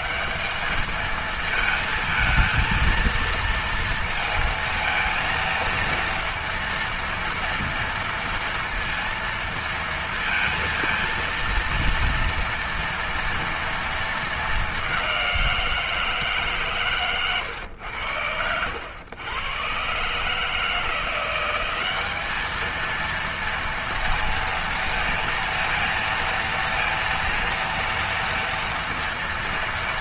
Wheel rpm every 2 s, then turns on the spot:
210, 220, 230, 230, 230, 230, 230, 220, 160, 90, 140, 210, 230, 230, 240.
18-20